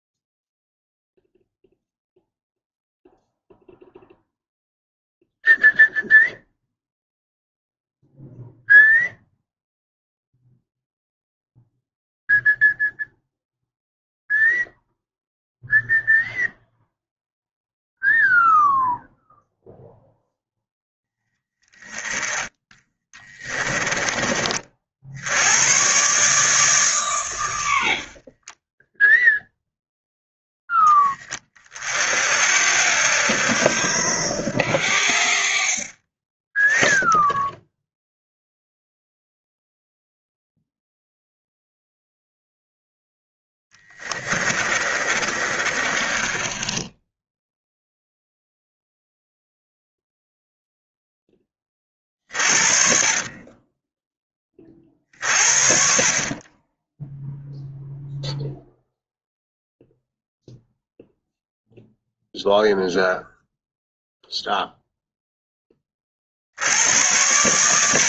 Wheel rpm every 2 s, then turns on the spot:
0, 0, 0, 0, 0, 0, 0, 0, 0, 0, 0, 10, 50, 140, 10, 10, 70, 70, 20, 0, 0, 0, 20, 10, 0, 0, 50, 30, 20, 0, 0, 0, 0, 80.
22-24 28-30 44-48 52-54